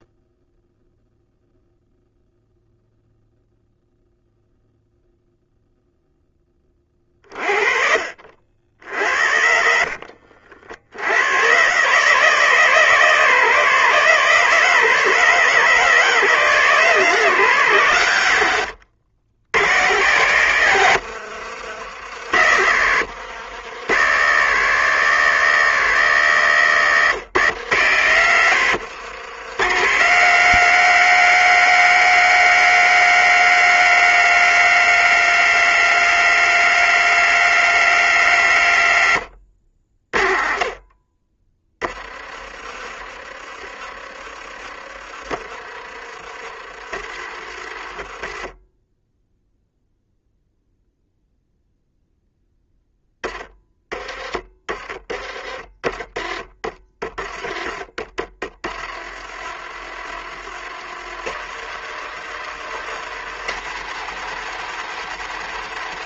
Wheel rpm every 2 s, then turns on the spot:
0, 0, 0, 20, 60, 80, 150, 150, 150, 90, 100, 80, 160, 130, 110, 180, 180, 180, 180, 110, 20, 30, 30, 40, 10, 0, 10, 20, 20, 40, 60, 90, 120.
8-10 20-22 26-28